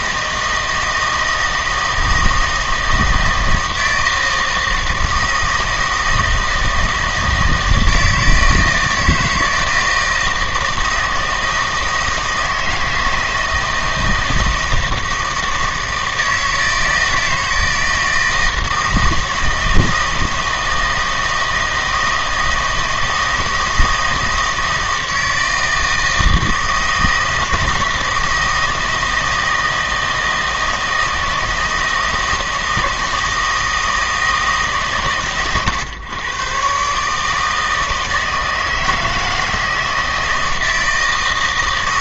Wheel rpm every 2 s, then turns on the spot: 160, 160, 160, 160, 160, 160, 160, 160, 160, 160, 160, 160, 160, 160, 160, 160, 160, 150, 130, 160, 160.
none